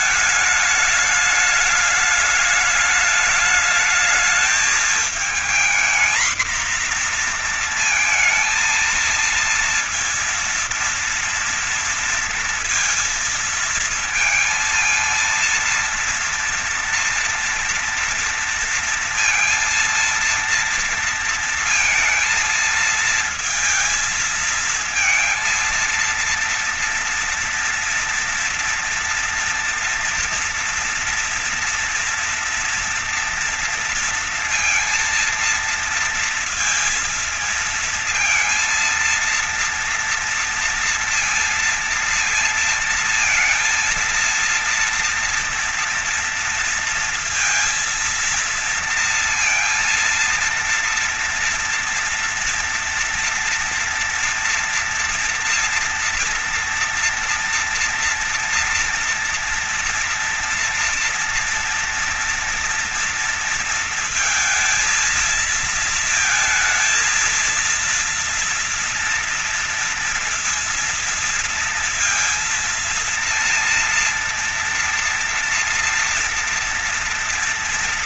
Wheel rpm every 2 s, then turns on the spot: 220, 210, 220, 230, 230, 230, 230, 230, 230, 230, 230, 230, 220, 230, 230, 240, 240, 230, 230, 230, 230, 230, 240, 230, 230, 230, 230, 230, 230, 230, 230, 230, 230, 230, 230, 230, 230, 230, 230.
none